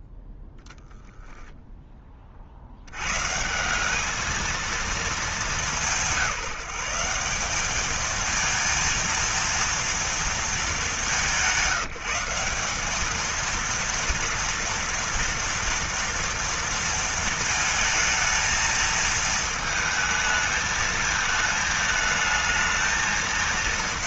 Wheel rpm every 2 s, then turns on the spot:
0, 80, 220, 170, 230, 210, 200, 230, 230, 230, 220, 220.
none